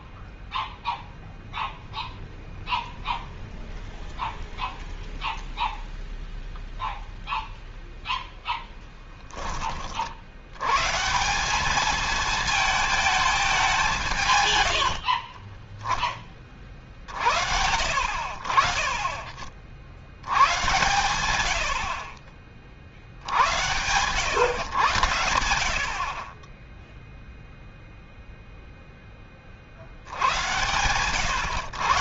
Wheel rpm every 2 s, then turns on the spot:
0, 0, 0, 0, 10, 130, 220, 90, 50, 40, 110, 50, 110, 10, 0, 100.
none